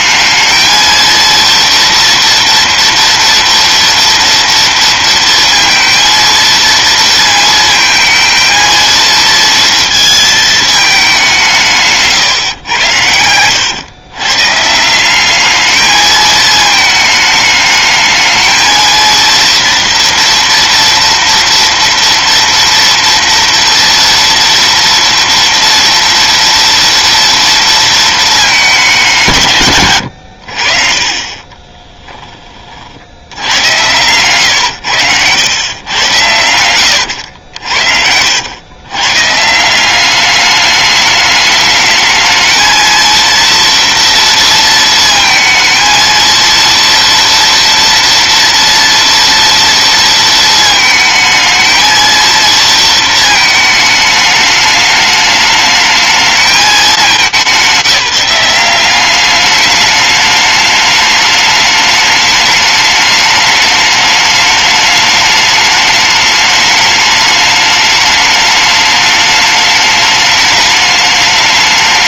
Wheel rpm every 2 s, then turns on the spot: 230, 230, 230, 230, 230, 200, 100, 180, 220, 230, 240, 240, 230, 230, 190, 40, 70, 100, 90, 120, 210, 230, 230, 230, 230, 220, 230, 210, 200, 190, 210, 210, 210, 210, 210, 210.
12-14 36-38